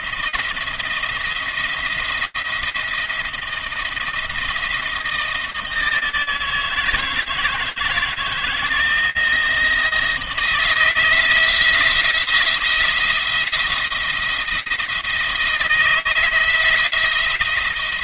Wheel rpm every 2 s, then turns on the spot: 170, 170, 160, 160, 160, 170, 170, 160, 170.
none